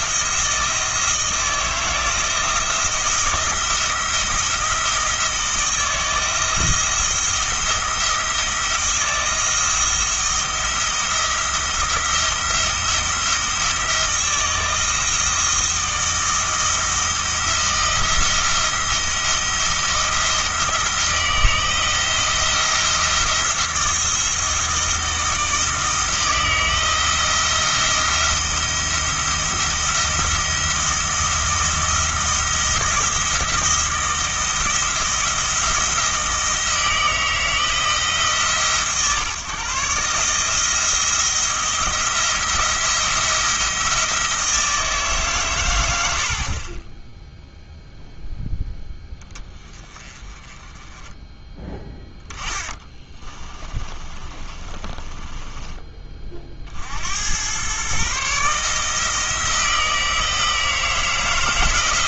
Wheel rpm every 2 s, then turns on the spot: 160, 170, 170, 160, 170, 170, 170, 160, 160, 170, 160, 170, 160, 160, 170, 170, 170, 170, 160, 140, 160, 170, 160, 20, 10, 20, 10, 30, 60, 160, 160.
52-56